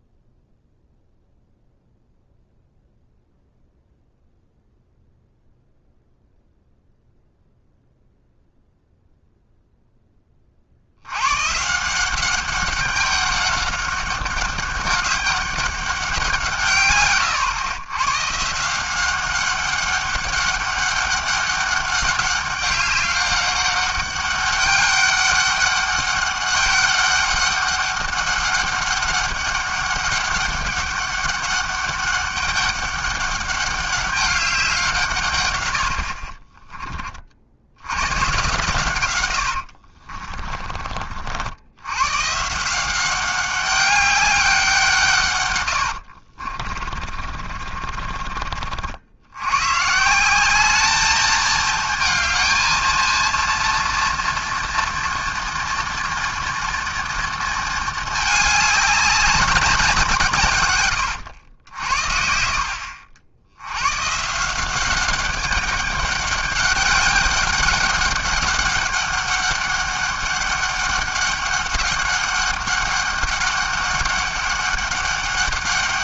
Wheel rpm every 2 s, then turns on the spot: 0, 0, 0, 0, 0, 50, 200, 200, 160, 160, 200, 200, 200, 200, 200, 200, 200, 180, 30, 120, 30, 160, 180, 40, 50, 200, 230, 230, 230, 210, 130, 60, 170, 190, 200, 200, 190, 200.
36-38 40-42 46-48